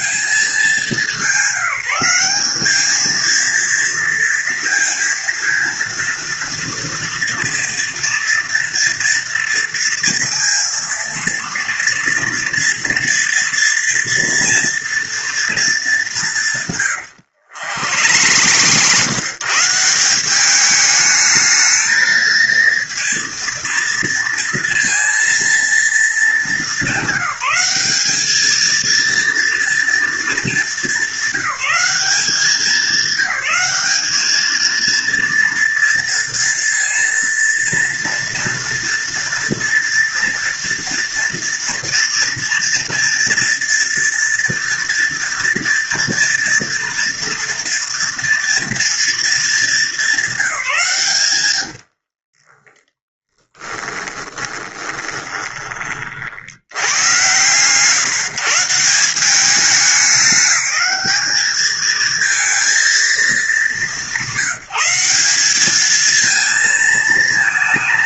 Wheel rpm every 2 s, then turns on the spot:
210, 200, 230, 230, 230, 230, 230, 230, 160, 100, 190, 230, 230, 210, 220, 220, 200, 220, 230, 230, 230, 230, 230, 230, 230, 180, 20, 20, 70, 140, 200, 220, 180, 230.
18-20 52-56